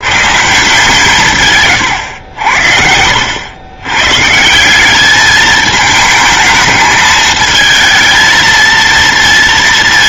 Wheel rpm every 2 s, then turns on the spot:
140, 70, 180, 220, 230.
none